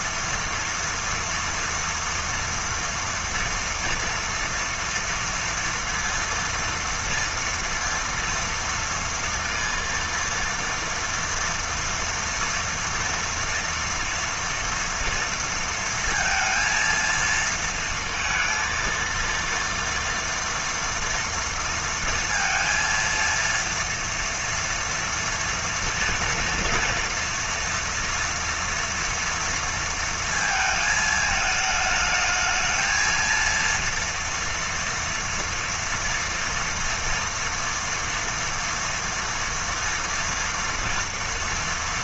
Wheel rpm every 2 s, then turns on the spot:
230, 230, 230, 230, 230, 230, 230, 230, 230, 230, 240, 230, 230, 230, 230, 220, 220, 230, 230, 230, 230.
none